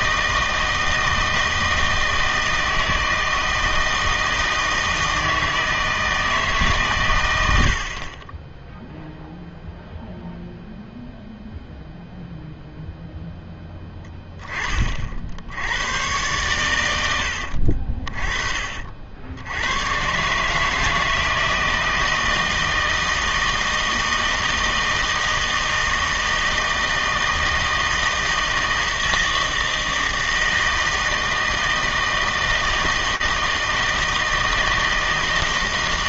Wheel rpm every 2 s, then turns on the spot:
160, 160, 160, 140, 0, 0, 0, 30, 120, 40, 150, 160, 160, 160, 160, 160, 160, 160.
none